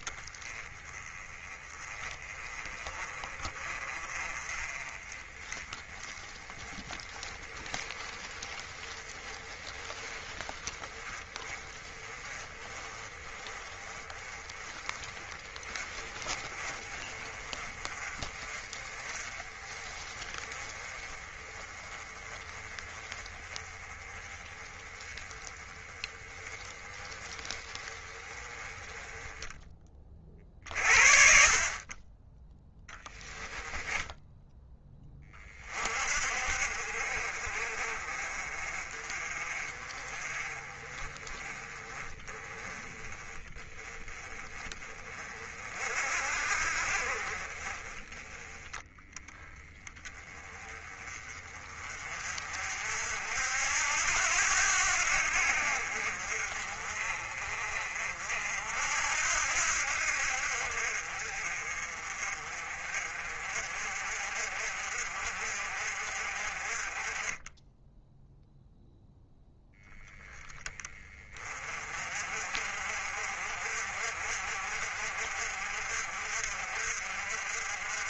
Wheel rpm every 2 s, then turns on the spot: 20, 30, 30, 20, 20, 20, 20, 20, 30, 30, 20, 20, 20, 20, 20, 50, 10, 10, 50, 40, 30, 20, 30, 40, 10, 20, 60, 80, 50, 70, 60, 40, 50, 30, 0, 20, 50, 50, 50.
32-34